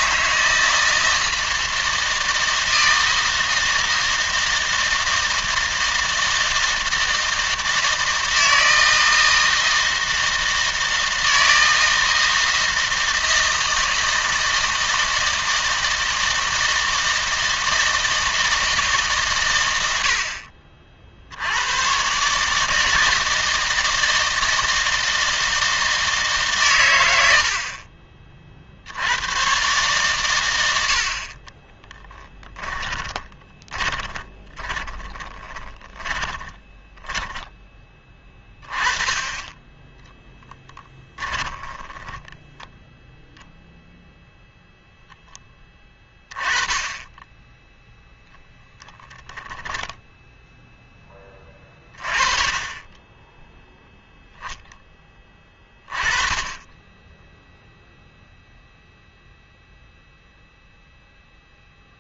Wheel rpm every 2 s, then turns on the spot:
160, 160, 160, 160, 160, 160, 160, 160, 160, 160, 50, 160, 160, 130, 50, 90, 20, 20, 20, 20, 10, 10, 0, 10, 10, 0, 30, 10, 20, 0, 0.
32-38 40-42